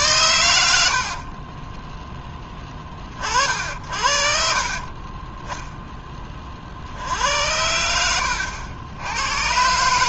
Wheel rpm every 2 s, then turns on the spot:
60, 30, 30, 60, 90.
4-6